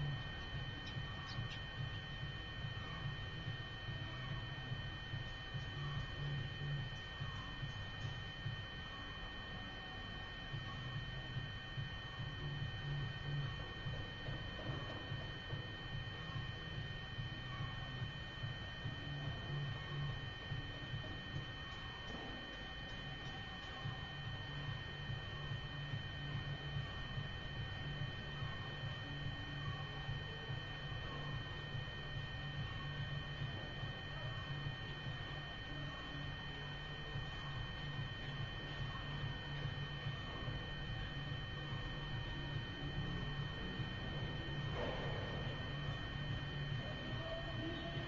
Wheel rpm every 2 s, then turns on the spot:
0, 0, 0, 0, 0, 0, 0, 0, 0, 0, 0, 0, 0, 0, 0, 0, 0, 0, 0, 0, 0, 0, 0, 0.
none